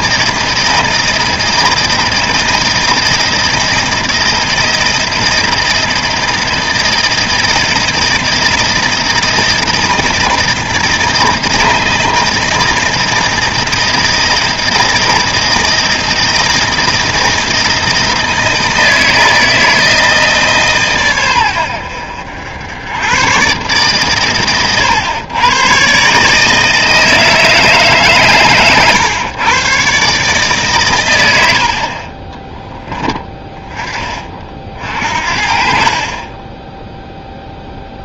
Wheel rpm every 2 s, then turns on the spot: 160, 160, 160, 170, 160, 160, 160, 160, 160, 160, 140, 80, 120, 150, 120, 140, 20, 40, 10.
24-26